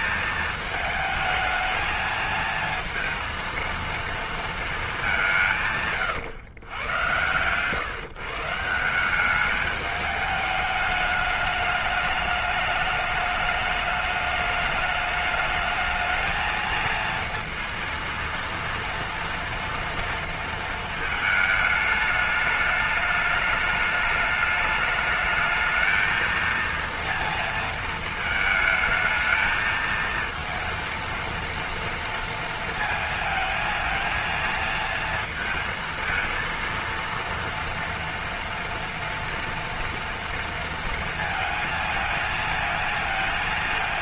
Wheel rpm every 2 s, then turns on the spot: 220, 220, 220, 120, 160, 210, 210, 210, 230, 230, 230, 210, 210, 230, 220, 230, 230, 230, 230, 230, 230, 230.
none